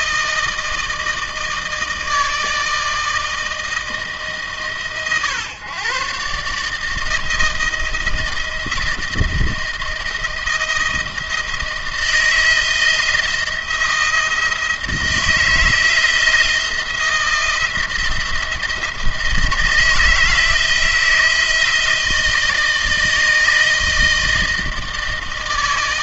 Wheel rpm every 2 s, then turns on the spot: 160, 160, 140, 150, 160, 160, 170, 170, 170, 170, 160, 160, 160.
none